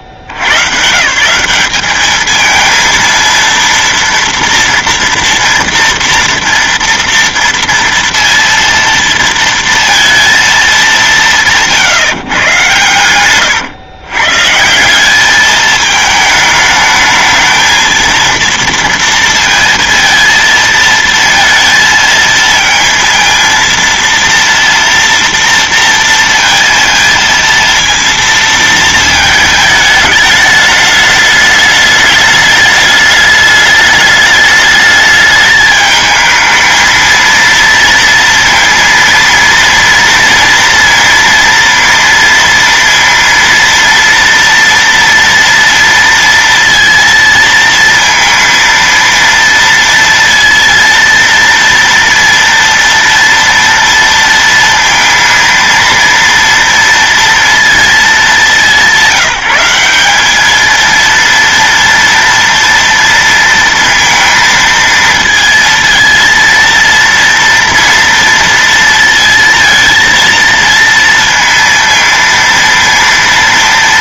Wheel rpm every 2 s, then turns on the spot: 60, 220, 230, 230, 230, 220, 120, 150, 220, 230, 230, 230, 230, 230, 230, 210, 210, 210, 220, 230, 230, 230, 230, 230, 230, 230, 230, 230, 230, 200, 220, 230, 230, 230, 230, 230, 230.
none